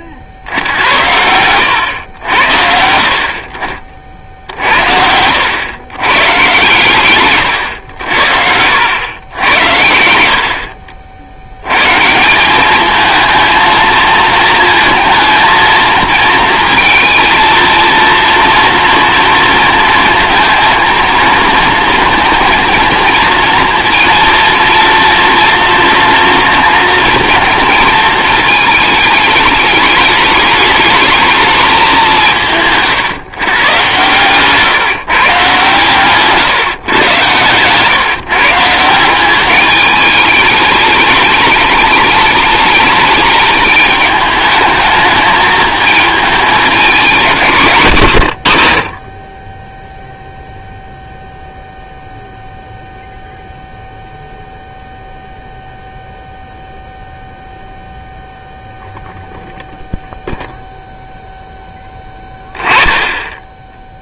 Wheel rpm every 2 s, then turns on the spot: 70, 60, 70, 130, 90, 60, 200, 220, 230, 240, 230, 230, 230, 230, 220, 220, 150, 140, 130, 160, 210, 210, 210, 210, 80, 0, 0, 0, 0, 0, 0, 10.
none